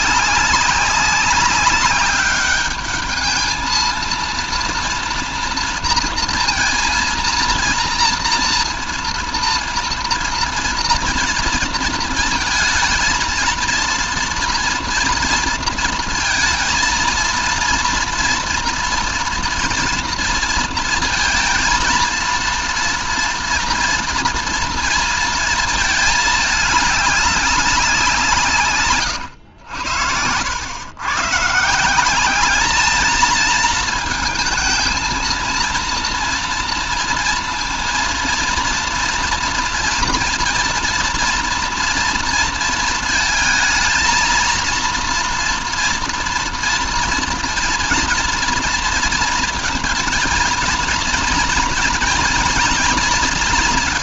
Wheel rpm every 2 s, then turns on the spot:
190, 210, 230, 230, 230, 230, 230, 230, 230, 230, 230, 230, 230, 210, 130, 110, 220, 220, 230, 230, 240, 230, 230, 230, 230, 230, 230.
none